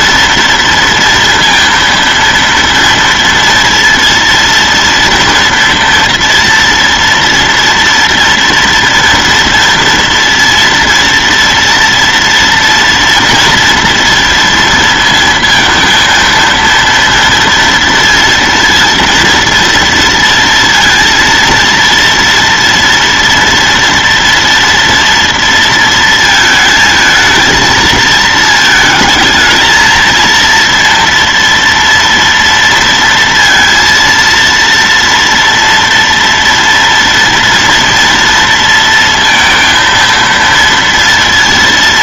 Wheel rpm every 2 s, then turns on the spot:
230, 230, 230, 230, 240, 230, 230, 230, 230, 230, 230, 230, 230, 220, 220, 230, 230, 230, 230, 230, 230.
none